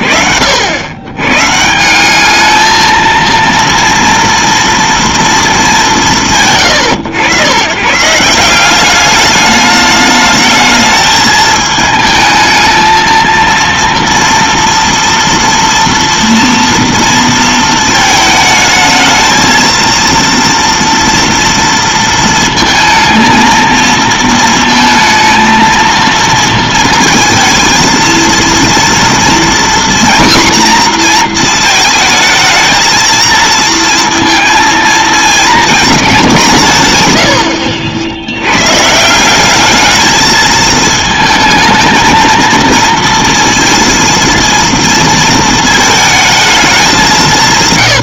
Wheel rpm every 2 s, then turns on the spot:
120, 230, 230, 100, 210, 220, 230, 230, 230, 220, 230, 230, 220, 230, 240, 230, 230, 230, 100, 190, 220, 230, 230, 200.
none